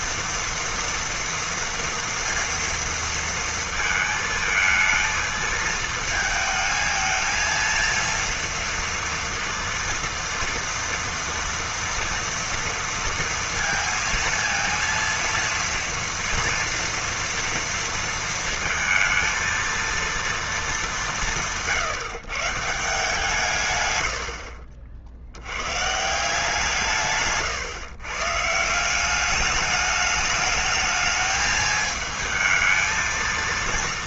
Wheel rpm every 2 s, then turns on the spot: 230, 230, 220, 220, 230, 240, 230, 230, 230, 230, 170, 160, 70, 140, 190, 210, 220.
none